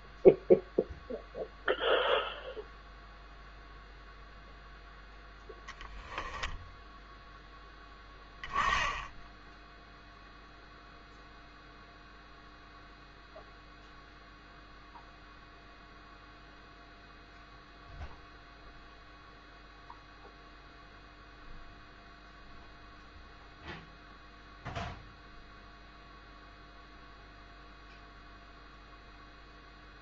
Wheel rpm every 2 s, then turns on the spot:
0, 0, 0, 0, 10, 0, 0, 0, 0, 0, 0, 0, 0, 0, 0.
none